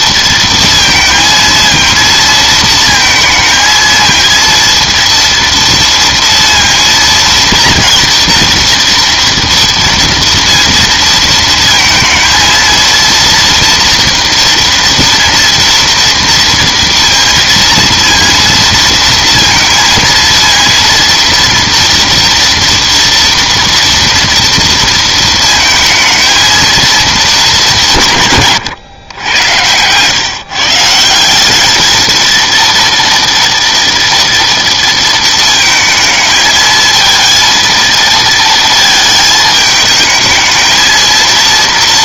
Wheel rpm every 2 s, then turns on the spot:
230, 230, 230, 230, 230, 230, 230, 230, 230, 230, 230, 230, 230, 230, 130, 160, 230, 230, 220, 220, 220.
none